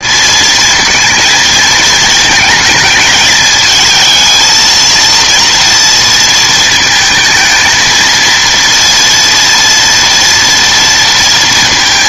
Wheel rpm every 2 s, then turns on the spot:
230, 220, 230, 220, 230, 230.
none